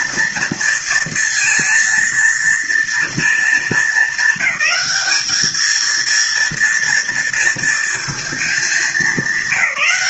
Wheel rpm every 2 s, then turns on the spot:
230, 230, 210, 230, 230.
none